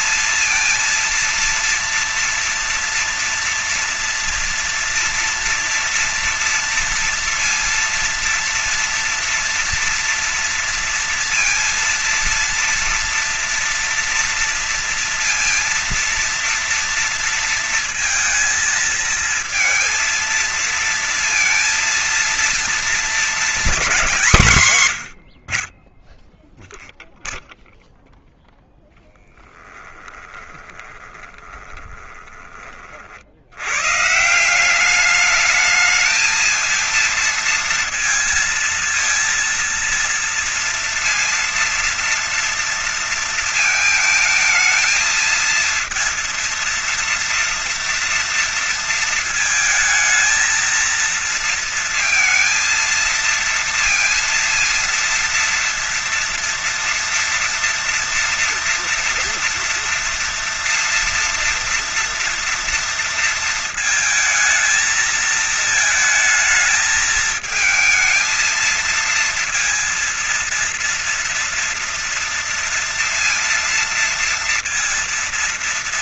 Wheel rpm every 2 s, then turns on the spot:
230, 230, 230, 230, 230, 230, 230, 230, 230, 230, 230, 230, 150, 0, 0, 20, 30, 180, 220, 230, 230, 230, 220, 230, 230, 230, 230, 230, 230, 230, 230, 230, 220, 220, 220, 230, 230, 230.
30-32